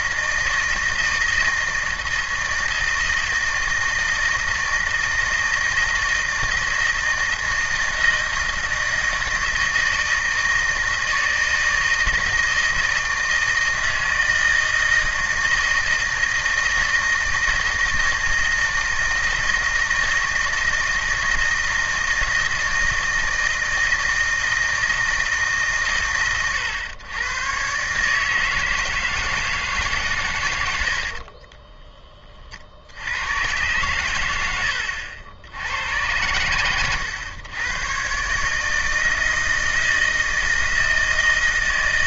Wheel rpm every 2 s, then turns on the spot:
170, 160, 160, 160, 160, 160, 160, 170, 160, 160, 160, 160, 160, 120, 160, 90, 50, 90, 110, 160, 160.
34-36